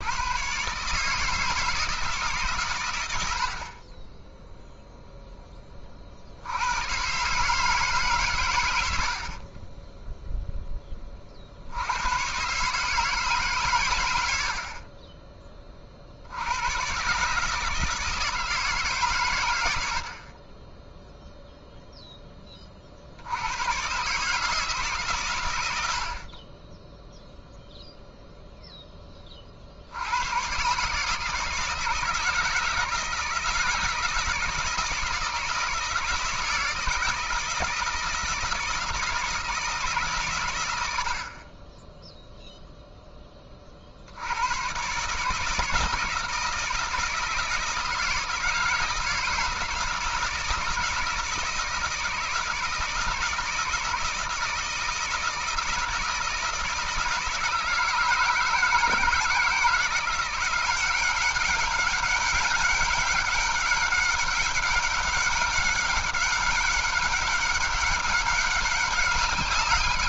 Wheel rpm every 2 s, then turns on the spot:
130, 130, 0, 90, 100, 10, 140, 60, 110, 160, 20, 30, 150, 20, 0, 130, 160, 160, 160, 160, 100, 0, 110, 160, 160, 160, 160, 160, 160, 160, 180, 200, 200, 200, 200.
none